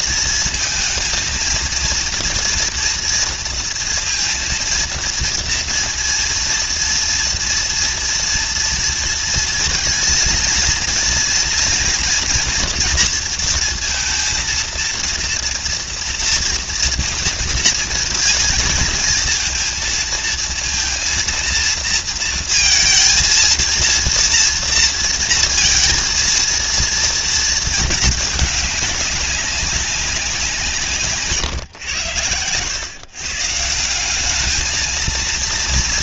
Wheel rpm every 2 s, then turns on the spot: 230, 230, 230, 230, 230, 230, 230, 230, 230, 230, 230, 230, 230, 230, 200, 140, 140, 230.
none